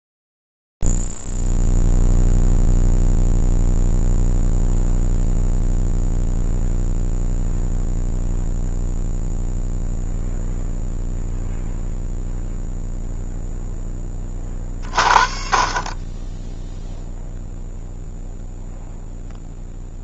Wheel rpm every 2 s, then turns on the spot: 0, 0, 0, 0, 0, 0, 0, 30, 10, 0.
none